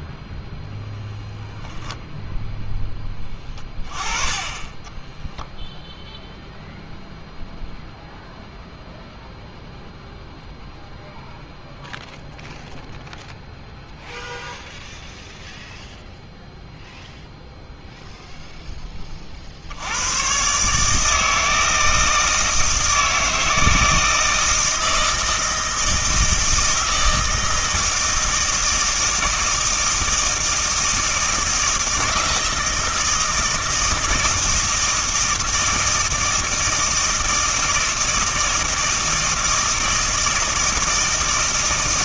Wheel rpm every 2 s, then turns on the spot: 10, 10, 20, 0, 0, 0, 0, 0, 0, 10, 140, 160, 160, 160, 160, 160, 160, 160, 160, 160, 160.
4-6